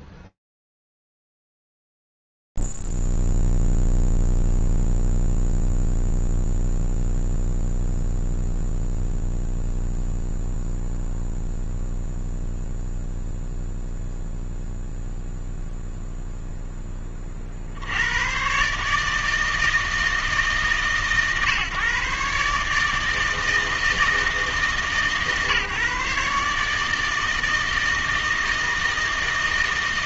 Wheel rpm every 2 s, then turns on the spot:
0, 0, 0, 0, 0, 0, 0, 0, 0, 110, 150, 140, 160, 150, 160.
none